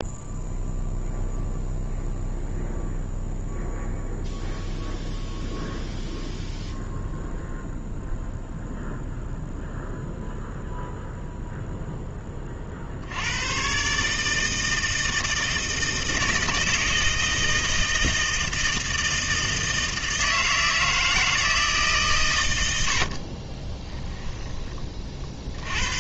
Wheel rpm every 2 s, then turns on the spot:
0, 0, 0, 0, 0, 0, 50, 160, 160, 160, 160, 80, 20.
none